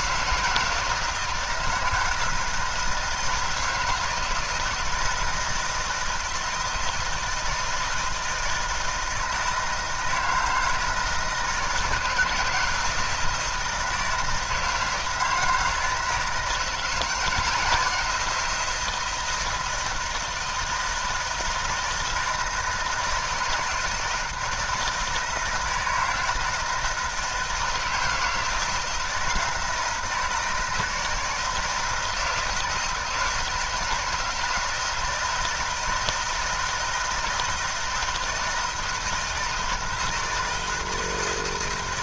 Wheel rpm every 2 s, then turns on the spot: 160, 160, 160, 160, 160, 160, 160, 160, 170, 170, 160, 160, 160, 160, 160, 160, 160, 160, 160, 160, 160.
none